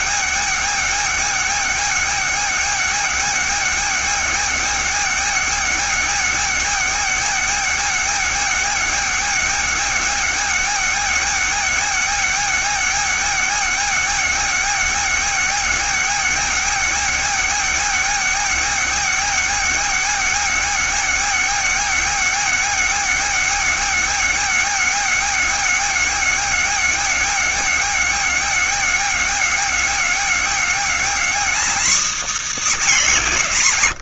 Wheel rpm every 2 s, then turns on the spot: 270, 270, 270, 270, 270, 270, 270, 270, 270, 270, 270, 270, 260, 270, 260, 270, 260.
none